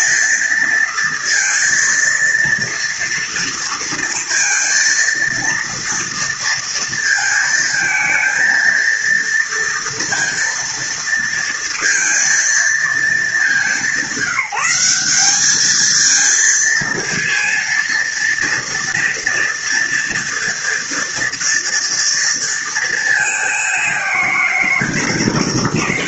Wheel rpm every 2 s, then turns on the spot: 230, 230, 230, 230, 230, 230, 230, 190, 230, 230, 230, 230, 180.
none